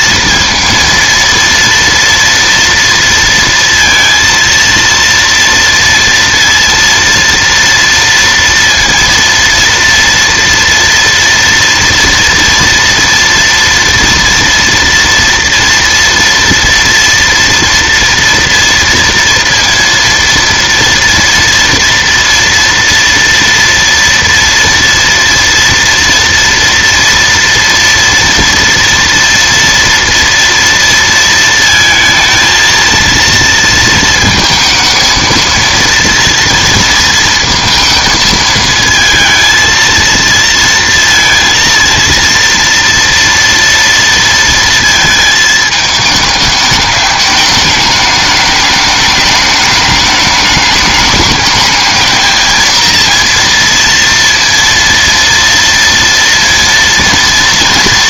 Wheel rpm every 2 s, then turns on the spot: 230, 230, 230, 230, 230, 230, 230, 230, 230, 230, 230, 230, 230, 230, 230, 230, 230, 230, 230, 220, 230, 230, 230, 210, 210, 210, 230, 230, 230.
none